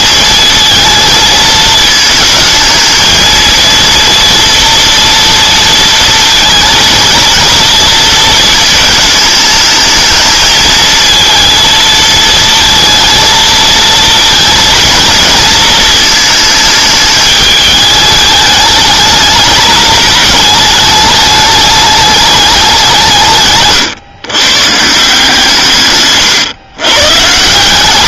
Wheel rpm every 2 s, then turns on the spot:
220, 220, 230, 230, 220, 220, 220, 230, 220, 210, 210, 190, 150, 130.
none